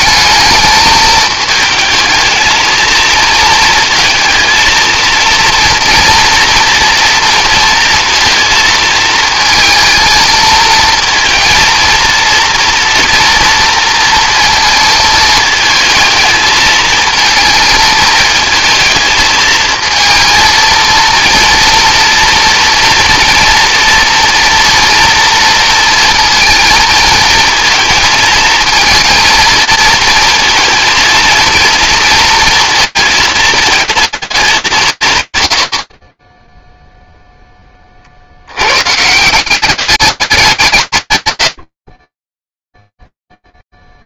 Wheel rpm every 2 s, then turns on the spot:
220, 230, 230, 230, 230, 230, 230, 230, 220, 220, 230, 240, 230, 230, 230, 230, 220, 160, 0, 140, 160, 0.
none